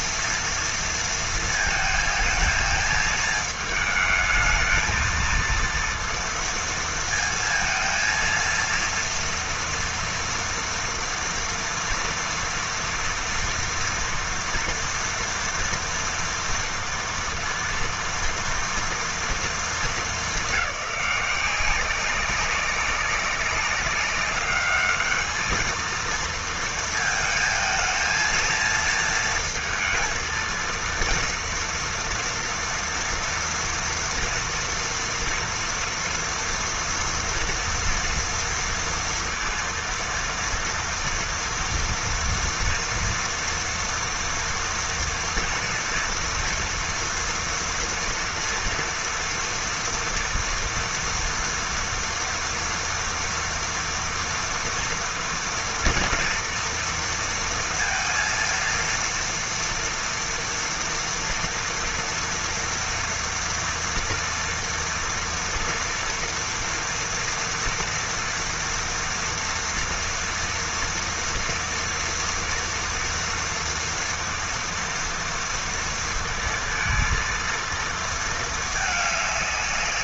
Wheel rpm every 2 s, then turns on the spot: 230, 220, 220, 230, 230, 230, 230, 230, 230, 230, 180, 200, 210, 230, 230, 230, 230, 230, 240, 230, 230, 230, 230, 230, 230, 230, 230, 230, 230, 230, 230, 240, 230, 230, 230, 240, 230, 230, 230, 210.
none